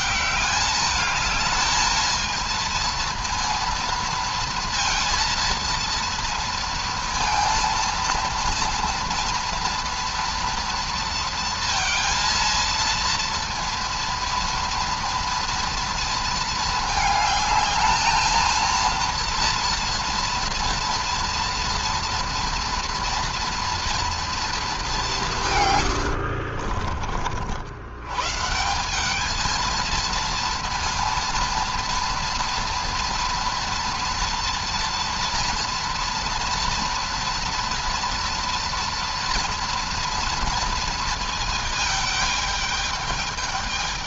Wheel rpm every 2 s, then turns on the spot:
200, 230, 230, 230, 230, 240, 230, 230, 220, 230, 230, 230, 220, 50, 180, 230, 230, 230, 230, 230, 230, 210.
26-28